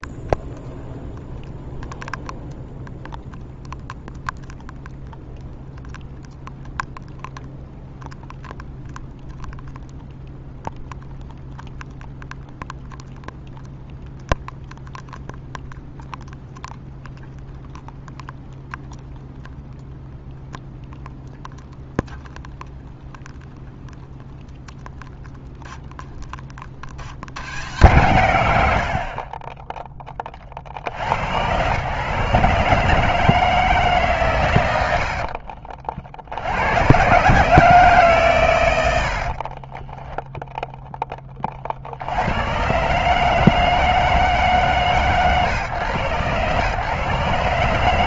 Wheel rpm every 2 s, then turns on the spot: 0, 0, 0, 0, 0, 0, 0, 0, 0, 0, 0, 0, 0, 30, 100, 40, 140, 110, 80, 110, 0, 120, 140, 120.
none